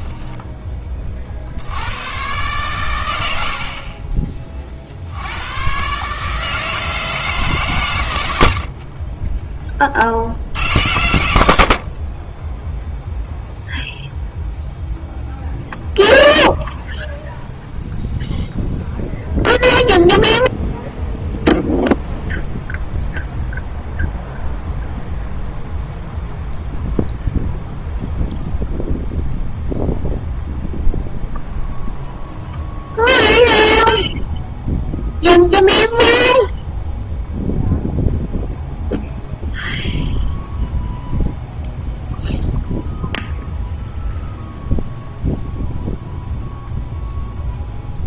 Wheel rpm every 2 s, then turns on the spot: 20, 110, 50, 160, 50, 100, 0, 0, 0, 0, 0, 0, 0, 0, 0, 0, 0, 0, 0, 0, 0, 0, 0, 0.
none